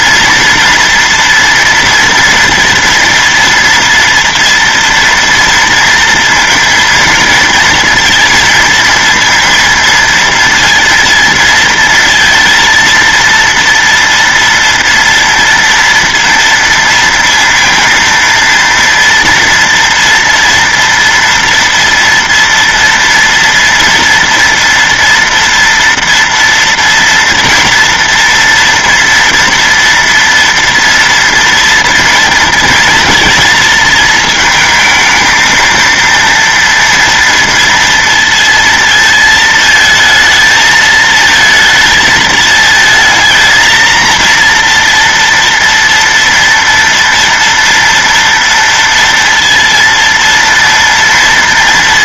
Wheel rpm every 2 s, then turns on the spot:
230, 230, 230, 230, 230, 230, 230, 230, 230, 230, 230, 230, 230, 240, 230, 230, 230, 220, 230, 230, 220, 220, 230, 230, 230, 230.
none